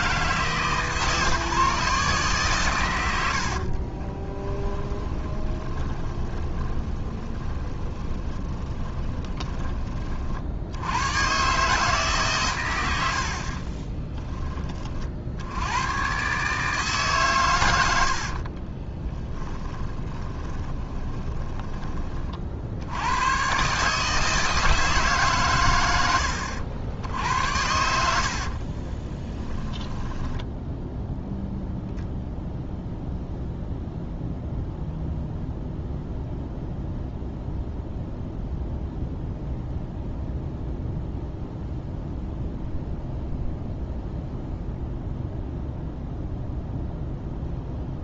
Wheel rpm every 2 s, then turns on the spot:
150, 130, 20, 20, 20, 70, 110, 30, 150, 30, 20, 70, 160, 70, 40, 0, 0, 0, 0, 0, 0, 0, 0, 0.
4-10 18-22 28-30